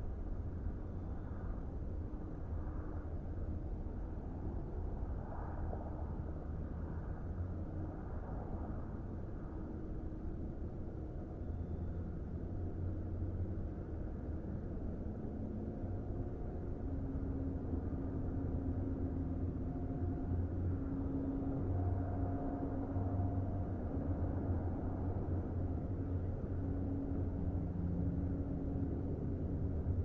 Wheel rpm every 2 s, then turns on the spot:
0, 0, 0, 0, 0, 0, 0, 0, 0, 0, 0, 0, 0, 0, 0.
none